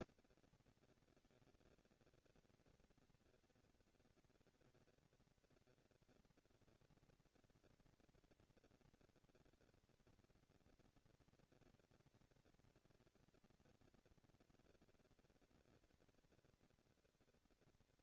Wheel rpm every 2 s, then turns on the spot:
230, 230, 240, 240, 240, 230, 230, 230, 240.
none